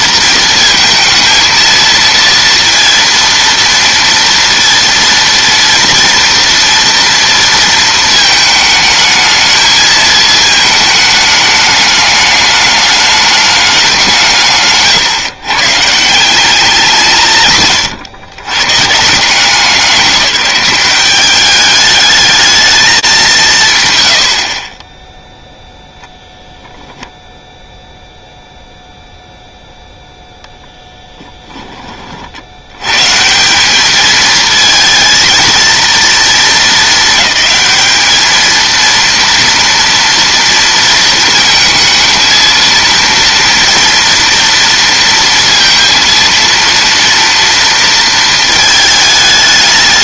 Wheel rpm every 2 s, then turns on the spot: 230, 230, 230, 230, 220, 220, 210, 140, 180, 140, 190, 220, 50, 0, 0, 0, 80, 230, 220, 230, 230, 230, 230, 230, 220.
none